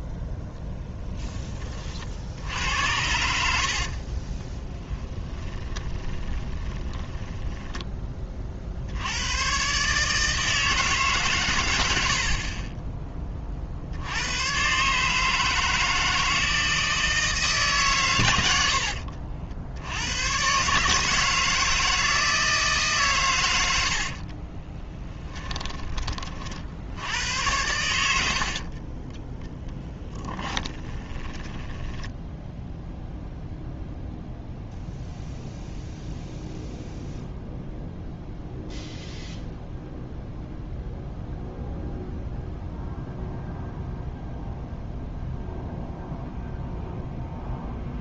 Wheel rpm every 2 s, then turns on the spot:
0, 70, 10, 20, 50, 160, 20, 140, 160, 80, 140, 150, 20, 80, 30, 20, 0, 0, 0, 0, 0, 0, 0, 0.
4-8 12-14 18-20 24-26 28-32